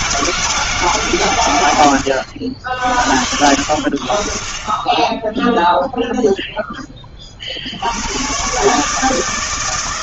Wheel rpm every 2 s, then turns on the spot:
160, 60, 50, 0, 130.
none